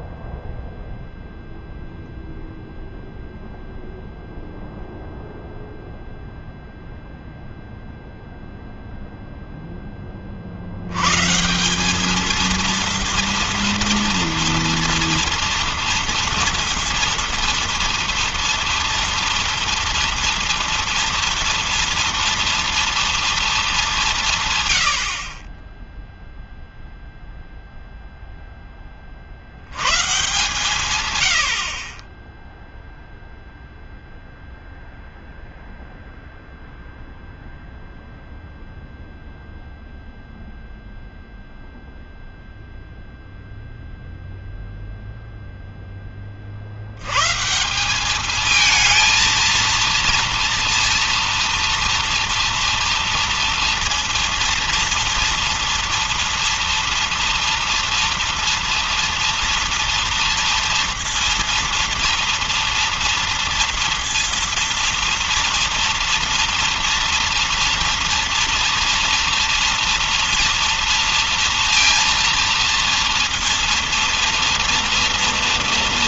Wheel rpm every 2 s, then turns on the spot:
0, 0, 0, 0, 0, 50, 220, 230, 230, 230, 230, 230, 160, 0, 10, 140, 10, 0, 0, 0, 0, 0, 0, 40, 210, 230, 230, 230, 230, 230, 230, 230, 230, 230, 230, 230, 230, 230.
none